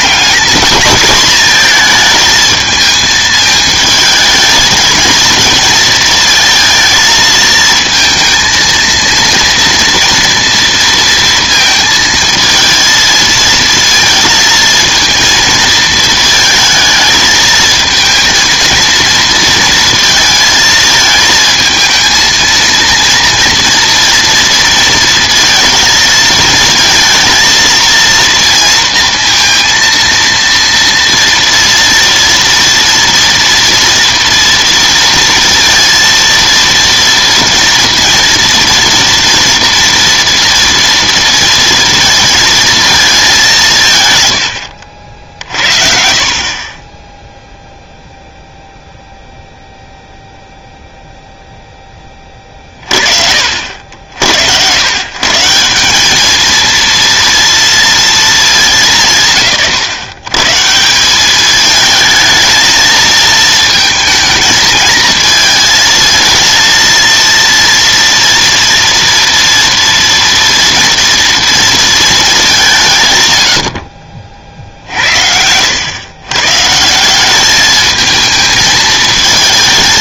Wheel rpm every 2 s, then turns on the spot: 220, 220, 220, 230, 230, 230, 220, 220, 220, 230, 230, 230, 230, 230, 230, 230, 230, 230, 230, 230, 240, 230, 90, 30, 0, 0, 30, 100, 230, 200, 160, 230, 230, 230, 230, 240, 190, 60, 150, 220.
none